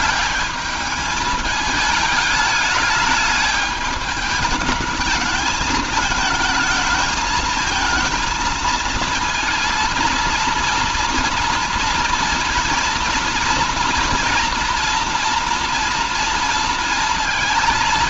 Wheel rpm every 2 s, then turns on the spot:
210, 210, 210, 220, 230, 240, 230, 230, 230.
none